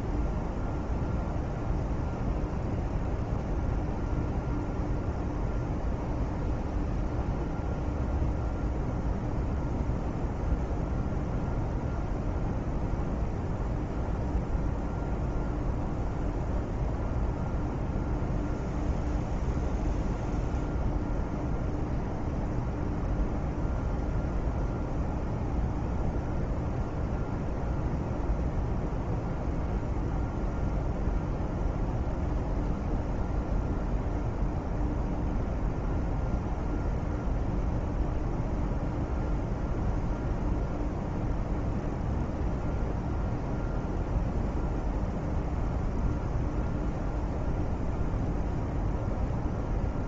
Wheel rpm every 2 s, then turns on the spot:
0, 0, 0, 0, 0, 0, 0, 0, 0, 0, 0, 0, 0, 0, 0, 0, 0, 0, 0, 0, 0, 0, 0, 0, 0.
none